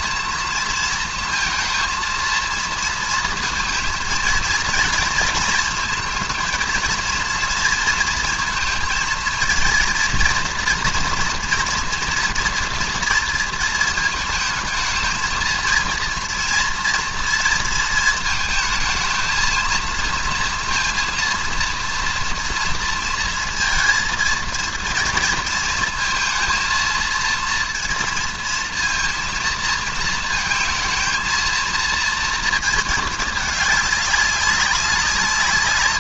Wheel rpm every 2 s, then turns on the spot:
230, 230, 230, 220, 230, 230, 230, 220, 230, 220, 230, 230, 230, 230, 230, 230, 230, 190.
none